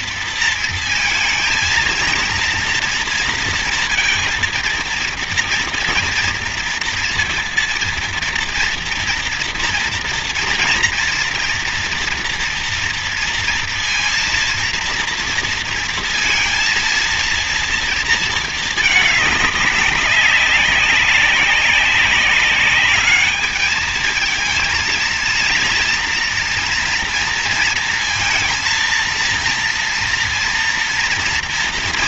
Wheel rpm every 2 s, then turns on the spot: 230, 230, 230, 230, 230, 230, 230, 230, 230, 220, 200, 200, 230, 230, 230, 230.
none